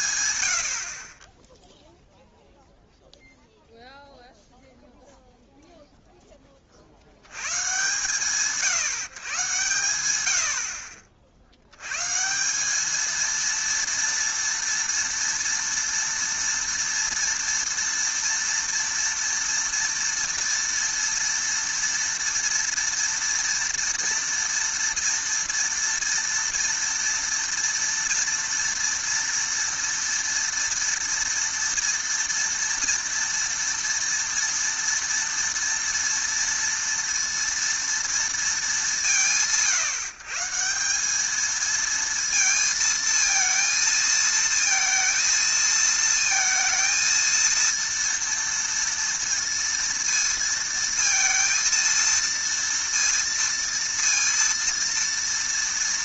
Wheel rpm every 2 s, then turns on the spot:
70, 0, 0, 40, 150, 60, 210, 230, 230, 230, 230, 240, 230, 230, 230, 230, 240, 230, 230, 210, 170, 230, 230, 230, 230, 230, 230, 230.
none